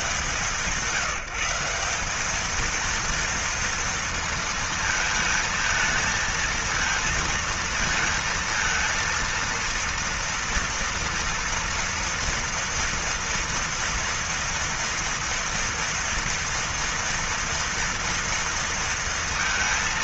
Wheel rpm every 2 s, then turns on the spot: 130, 190, 230, 220, 230, 230, 230, 230, 230, 230.
none